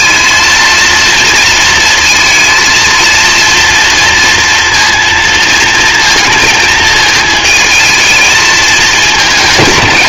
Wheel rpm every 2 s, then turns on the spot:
230, 230, 230, 220, 220.
none